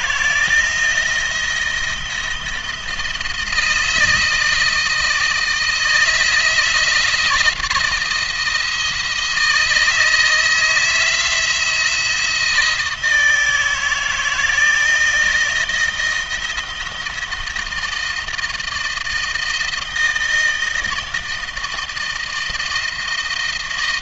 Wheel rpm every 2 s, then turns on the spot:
160, 170, 160, 160, 170, 160, 160, 160, 170, 160, 160, 160.
none